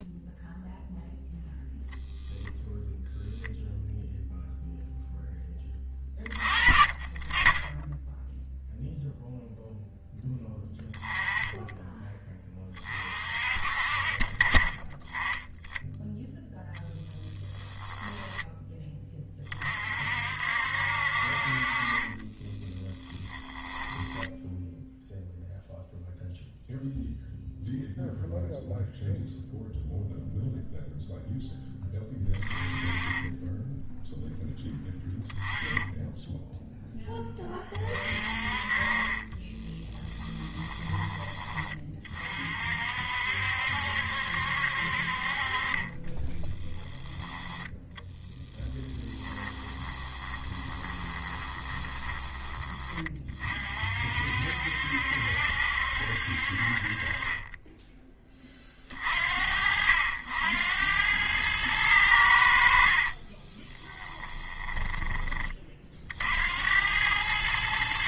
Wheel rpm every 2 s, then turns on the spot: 0, 0, 0, 20, 0, 10, 30, 20, 0, 10, 60, 20, 0, 0, 0, 0, 20, 10, 0, 40, 10, 50, 60, 10, 10, 20, 20, 60, 50, 30, 80, 70, 10, 80.
6-8 22-24 40-42 48-52 64-66